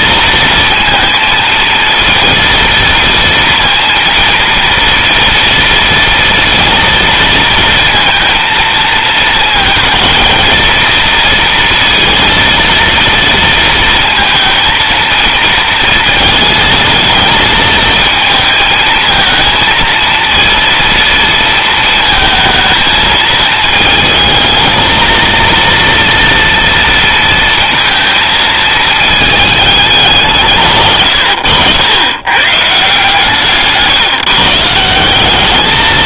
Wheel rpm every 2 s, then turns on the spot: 230, 230, 230, 230, 230, 230, 230, 230, 220, 220, 230, 220, 220, 230, 220, 120, 140, 170.
none